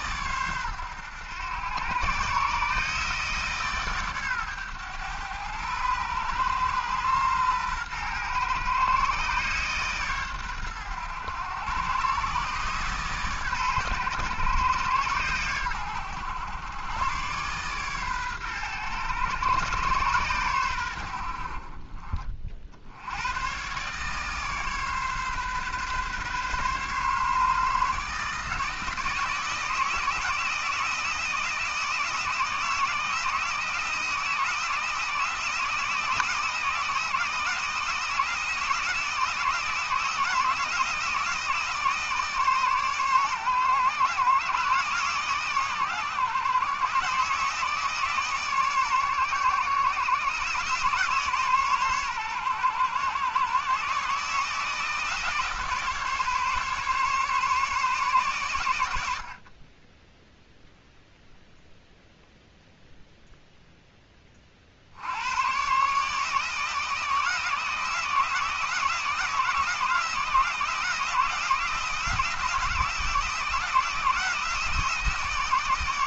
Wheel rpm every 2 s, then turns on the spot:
110, 140, 120, 120, 130, 110, 140, 120, 110, 120, 100, 60, 140, 130, 160, 160, 160, 160, 160, 160, 160, 140, 140, 140, 140, 140, 120, 160, 140, 100, 0, 0, 60, 160, 160, 160, 160, 160.
none